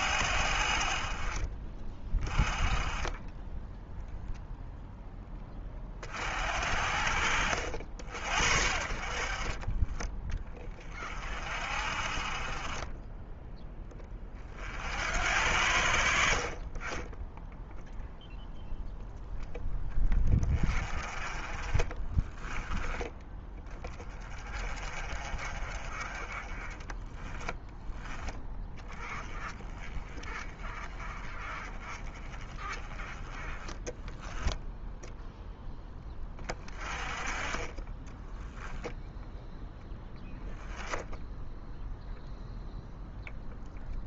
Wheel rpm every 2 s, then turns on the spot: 50, 20, 0, 60, 60, 30, 20, 50, 30, 0, 30, 10, 30, 20, 10, 20, 20, 0, 20, 0, 10, 0.
none